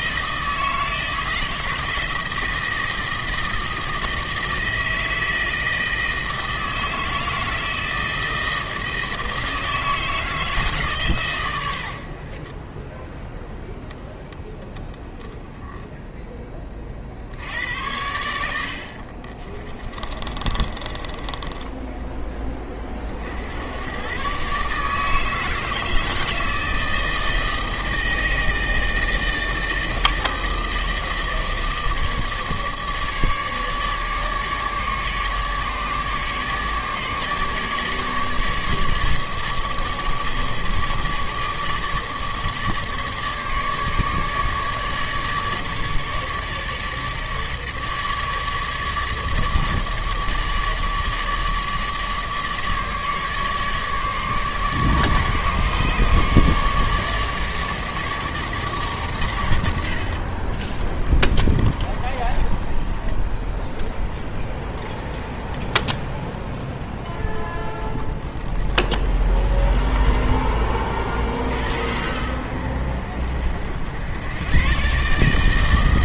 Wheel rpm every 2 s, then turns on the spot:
160, 160, 160, 160, 160, 150, 20, 0, 30, 60, 30, 30, 140, 160, 160, 160, 150, 150, 150, 150, 150, 150, 150, 150, 150, 150, 150, 150, 150, 140, 30, 20, 10, 0, 30, 30, 60, 120.
12-14 20-22 60-66 68-70